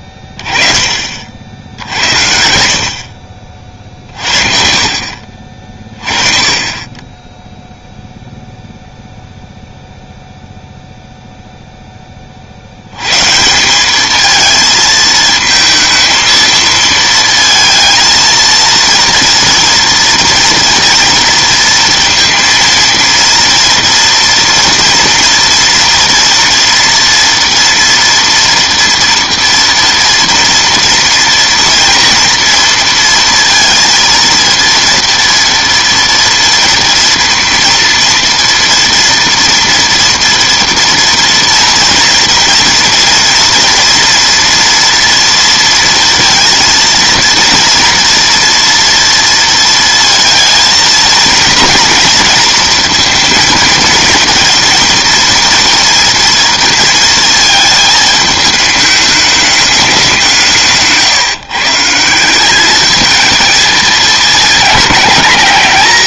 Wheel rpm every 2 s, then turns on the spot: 30, 70, 50, 30, 0, 0, 60, 220, 230, 230, 230, 230, 230, 230, 230, 230, 230, 230, 230, 230, 240, 230, 240, 230, 230, 230, 230, 230, 230, 210, 170, 200, 220.
none